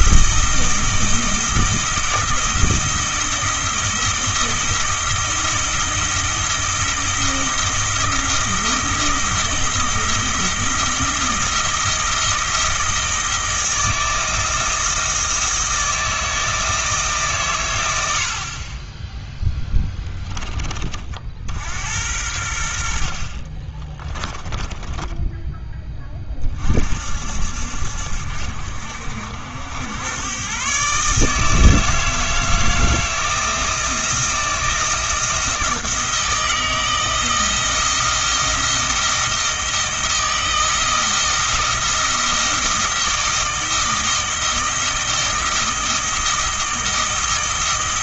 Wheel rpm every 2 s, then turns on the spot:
160, 160, 160, 160, 160, 170, 160, 160, 160, 30, 30, 70, 20, 50, 70, 140, 160, 170, 160, 160, 160, 160, 160, 170.
24-26